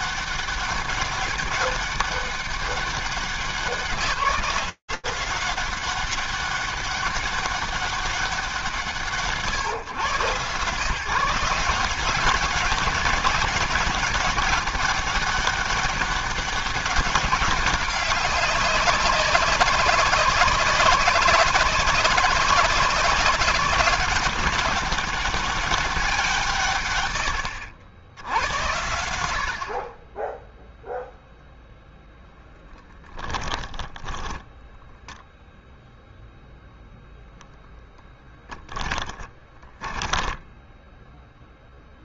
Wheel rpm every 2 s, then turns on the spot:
200, 200, 190, 200, 150, 160, 190, 200, 200, 190, 190, 190, 200, 120, 80, 0, 10, 10, 0, 20, 10.
32-36 38-42